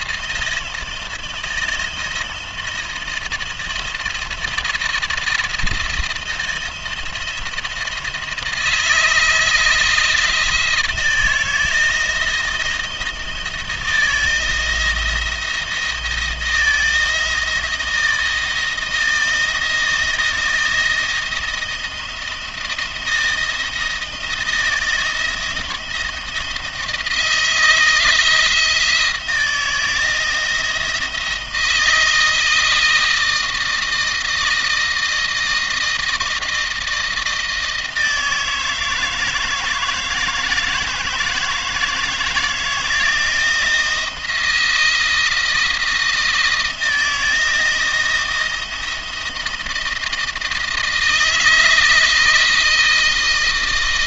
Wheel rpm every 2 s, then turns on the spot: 170, 160, 170, 170, 160, 160, 170, 170, 170, 170, 160, 160, 160, 160, 160, 160, 160, 160, 160, 160, 160, 170, 160, 170, 170, 160, 160.
none